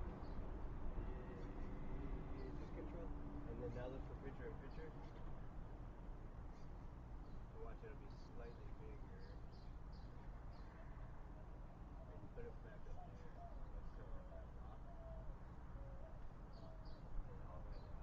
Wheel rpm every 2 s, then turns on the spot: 0, 0, 0, 0, 0, 0, 0, 0, 0.
none